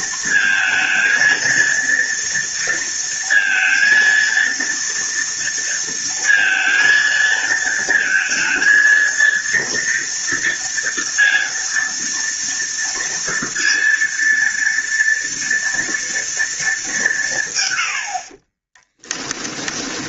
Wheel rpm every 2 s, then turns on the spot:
220, 230, 230, 230, 230, 230, 230, 230, 200, 20.
18-20